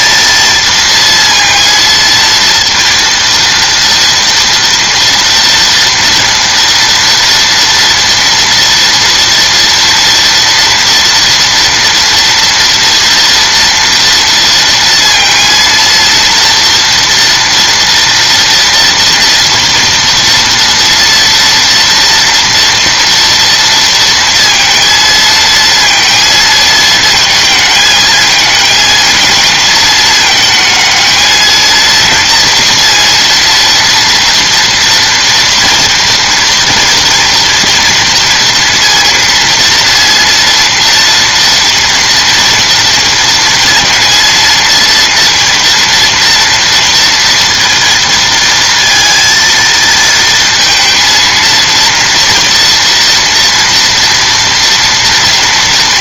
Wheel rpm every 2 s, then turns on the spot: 220, 230, 230, 230, 240, 230, 230, 230, 230, 230, 230, 230, 230, 220, 220, 220, 230, 230, 230, 230, 230, 230, 230, 230, 230, 220, 230, 230.
none